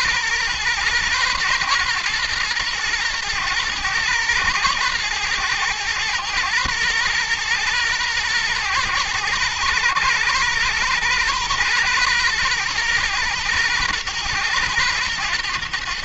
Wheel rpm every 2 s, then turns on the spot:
120, 120, 110, 110, 110, 120, 120, 120.
none